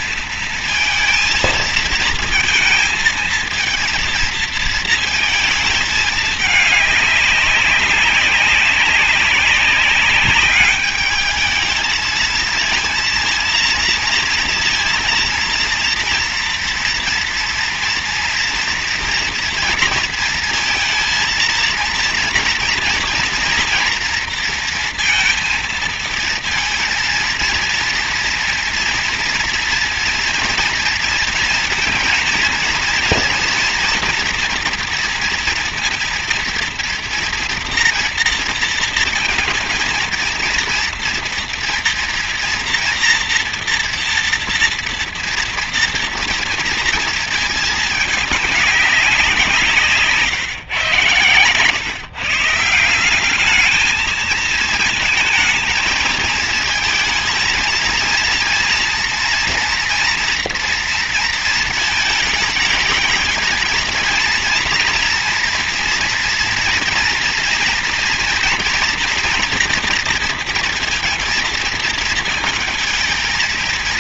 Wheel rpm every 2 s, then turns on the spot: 220, 230, 230, 200, 200, 210, 230, 230, 230, 230, 230, 240, 230, 230, 230, 230, 230, 240, 230, 230, 230, 240, 230, 230, 190, 120, 180, 220, 230, 230, 230, 220, 230, 230, 230, 230, 220.
none